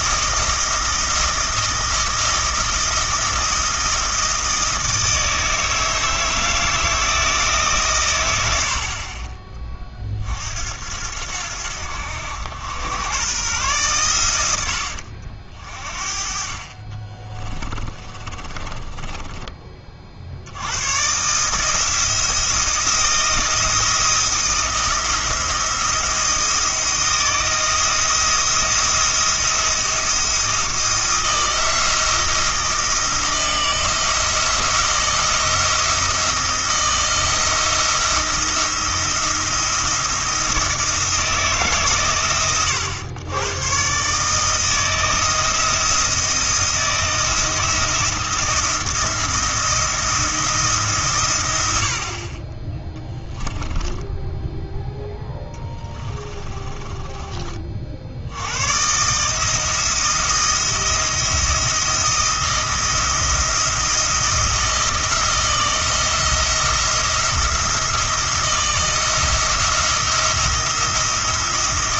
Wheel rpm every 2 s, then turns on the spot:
160, 170, 160, 160, 70, 70, 100, 90, 40, 30, 90, 170, 170, 170, 170, 170, 170, 170, 170, 170, 170, 110, 160, 170, 170, 160, 20, 0, 20, 110, 170, 170, 170, 160, 170, 170.
18-20 56-58